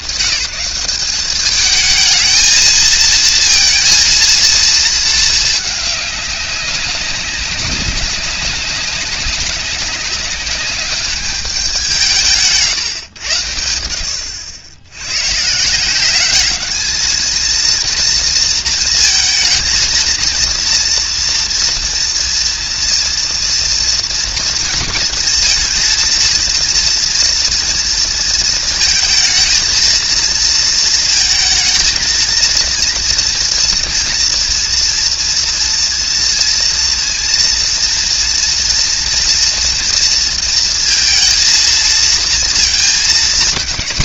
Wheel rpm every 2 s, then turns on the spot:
190, 220, 230, 200, 200, 200, 150, 70, 210, 230, 230, 230, 230, 230, 230, 230, 230, 230, 230, 230, 230, 230.
none